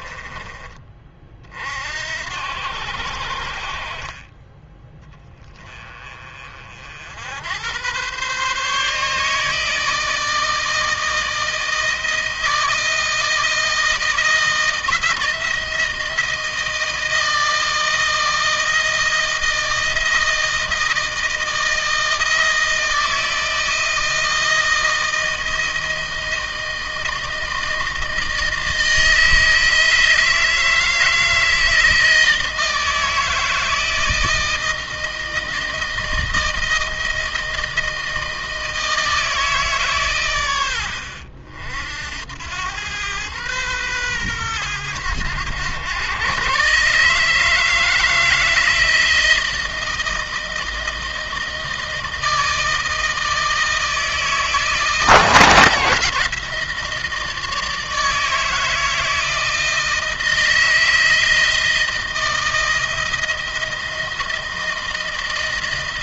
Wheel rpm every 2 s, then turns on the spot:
40, 70, 20, 60, 140, 160, 160, 170, 160, 160, 160, 160, 160, 160, 160, 160, 160, 160, 160, 160, 80, 100, 110, 140, 160, 160, 160, 160, 160, 160, 160, 160, 160.
none